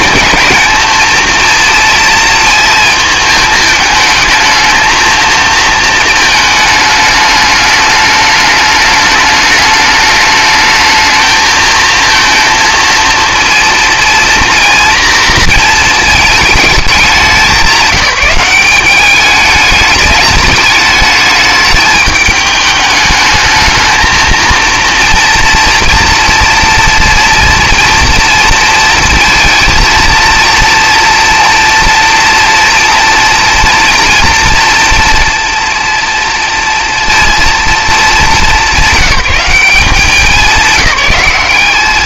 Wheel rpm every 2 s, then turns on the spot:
230, 230, 220, 220, 210, 220, 230, 240, 220, 190, 210, 210, 230, 230, 230, 230, 230, 230, 230, 190, 180.
none